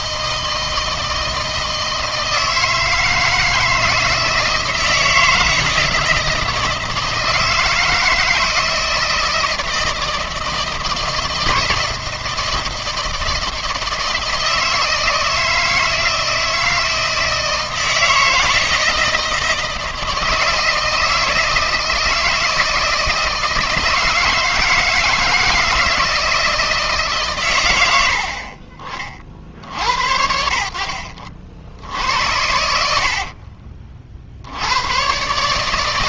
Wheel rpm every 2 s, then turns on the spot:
160, 160, 160, 160, 160, 160, 160, 160, 160, 160, 160, 160, 160, 160, 50, 60, 80, 90.
none